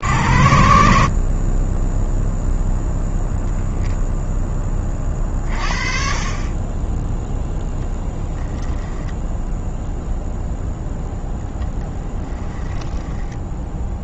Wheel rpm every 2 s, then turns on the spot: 70, 0, 0, 30, 10, 0, 10.
12-14